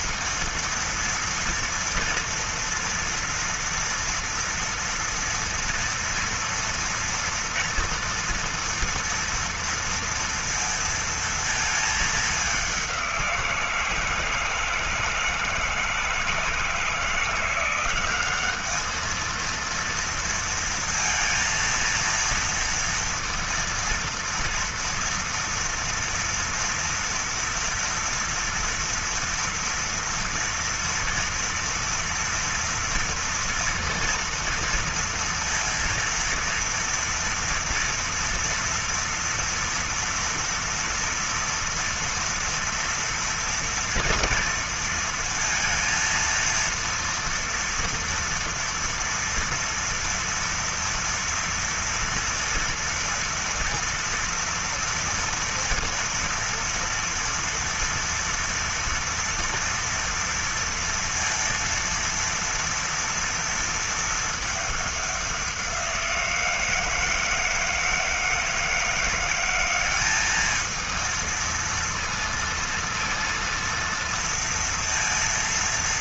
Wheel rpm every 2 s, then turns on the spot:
230, 230, 230, 240, 230, 230, 200, 160, 170, 200, 230, 230, 230, 230, 230, 230, 230, 230, 230, 230, 230, 230, 230, 230, 230, 230, 230, 230, 230, 230, 230, 230, 210, 170, 160, 210, 230, 230.
none